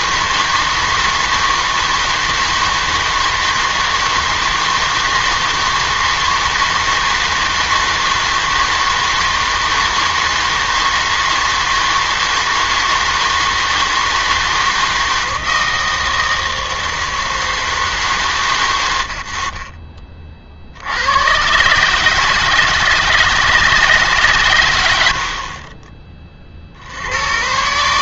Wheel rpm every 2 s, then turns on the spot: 160, 160, 160, 160, 160, 160, 160, 160, 160, 120, 60, 160, 110, 50.
none